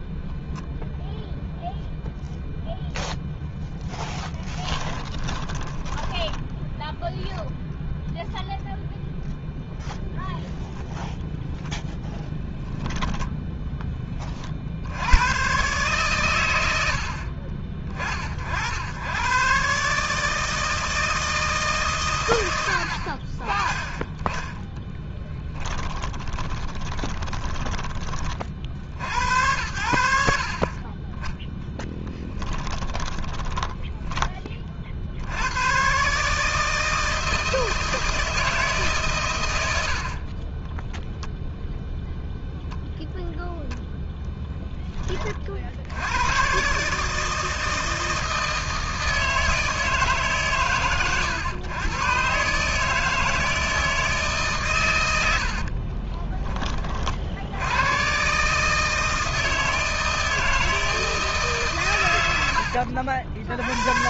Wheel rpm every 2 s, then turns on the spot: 0, 0, 10, 10, 0, 0, 10, 110, 60, 110, 160, 40, 10, 20, 80, 20, 10, 80, 160, 130, 0, 0, 10, 140, 160, 120, 160, 120, 30, 160, 160, 60.
4-6 12-14 24-28 32-34 62-64